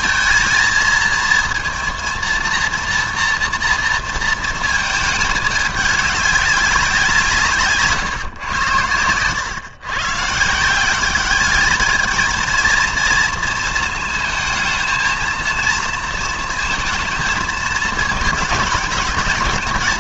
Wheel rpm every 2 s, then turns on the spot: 220, 230, 220, 190, 110, 180, 230, 230, 220, 210.
none